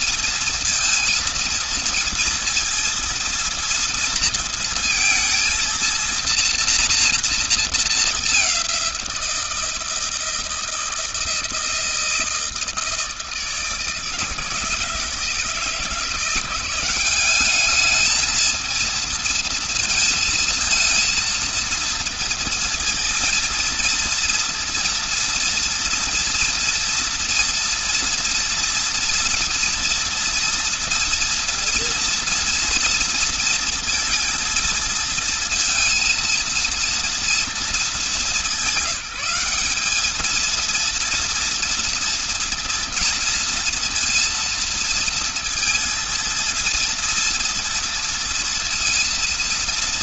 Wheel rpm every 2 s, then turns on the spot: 230, 230, 230, 240, 200, 160, 160, 160, 180, 220, 230, 230, 230, 230, 230, 240, 240, 230, 230, 190, 220, 230, 230, 230, 230.
none